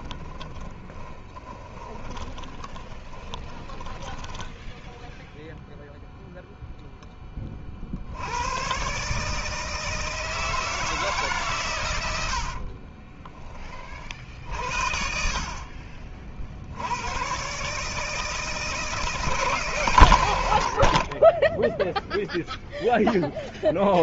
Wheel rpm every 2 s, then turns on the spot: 20, 20, 0, 0, 120, 160, 50, 60, 80, 170, 70, 0.
0-4 12-14